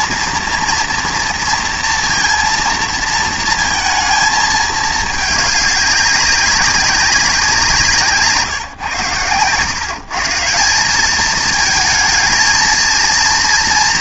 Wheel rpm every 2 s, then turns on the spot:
230, 230, 220, 190, 150, 180, 230.
none